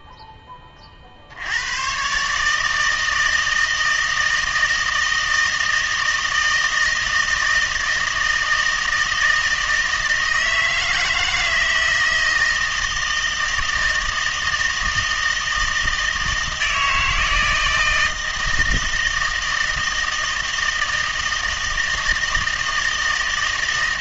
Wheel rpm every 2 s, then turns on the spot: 120, 160, 160, 160, 160, 160, 160, 160, 160, 160, 160, 160.
none